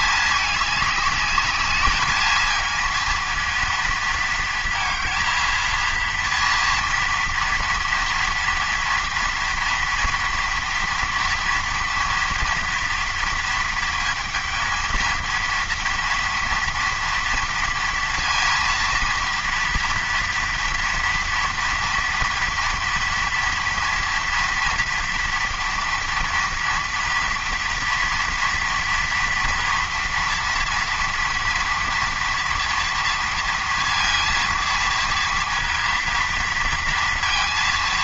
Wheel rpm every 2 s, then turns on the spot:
210, 220, 220, 230, 230, 230, 230, 230, 230, 230, 230, 230, 230, 230, 230, 240, 230, 230, 230.
none